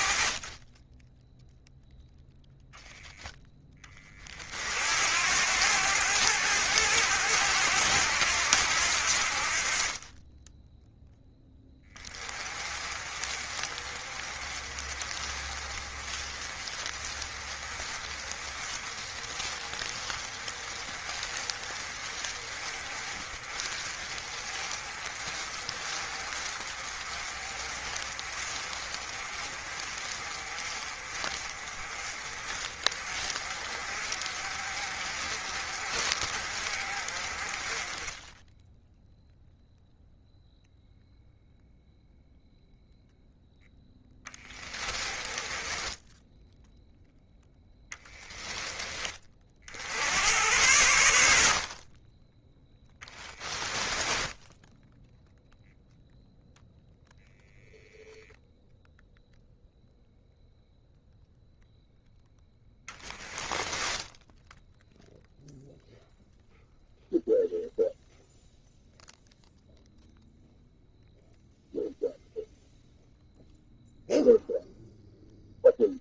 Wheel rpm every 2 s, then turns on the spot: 10, 0, 70, 90, 70, 0, 30, 30, 30, 30, 30, 30, 40, 40, 40, 40, 40, 40, 30, 0, 0, 0, 20, 0, 20, 90, 10, 0, 0, 0, 0, 10, 0, 0, 0, 0, 0, 0.
44-46 52-54